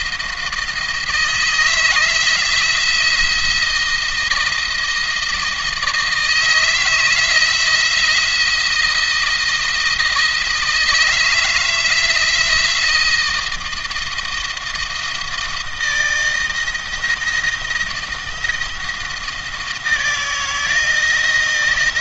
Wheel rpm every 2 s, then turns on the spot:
160, 170, 160, 160, 170, 160, 170, 160, 160, 160, 160.
none